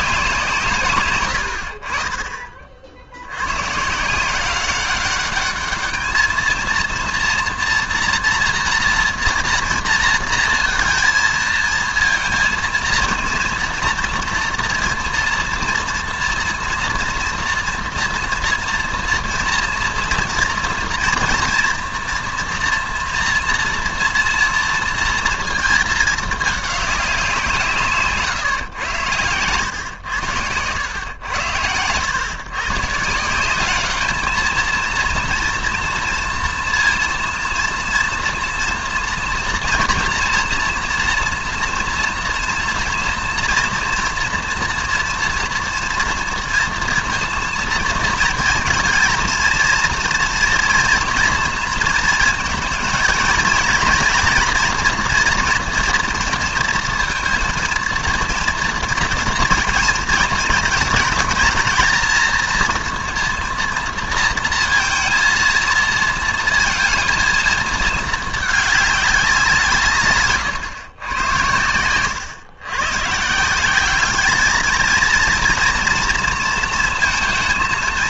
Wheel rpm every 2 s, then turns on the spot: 140, 50, 190, 230, 230, 230, 220, 230, 230, 240, 230, 240, 230, 210, 110, 110, 140, 230, 230, 230, 240, 240, 230, 230, 230, 230, 230, 240, 230, 230, 220, 230, 230, 230, 210, 120, 110, 220, 220.
none